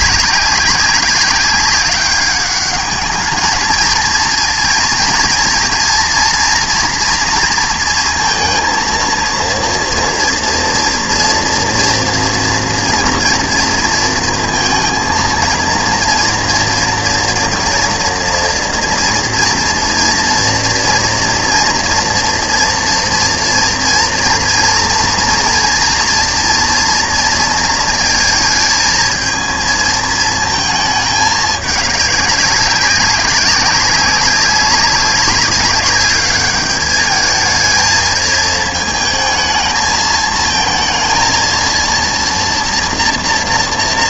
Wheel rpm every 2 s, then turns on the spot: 200, 200, 230, 240, 230, 230, 230, 230, 230, 240, 230, 230, 230, 240, 220, 230, 200, 200, 210, 220, 220, 230.
none